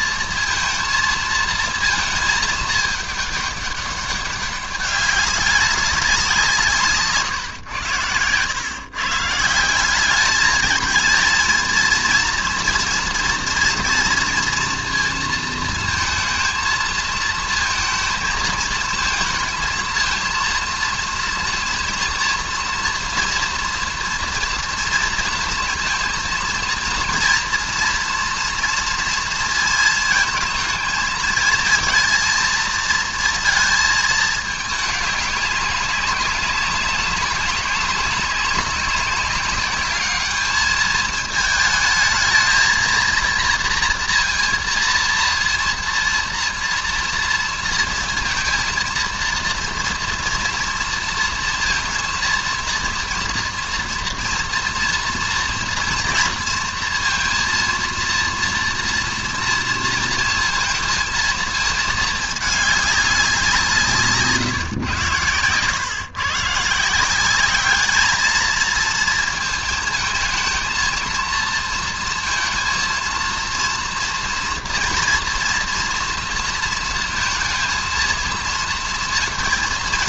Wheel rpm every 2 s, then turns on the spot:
230, 220, 200, 160, 130, 210, 230, 230, 220, 220, 230, 230, 230, 230, 230, 230, 230, 210, 190, 190, 210, 220, 230, 230, 230, 230, 240, 230, 230, 230, 230, 210, 140, 150, 220, 230, 230, 240, 230, 230.
none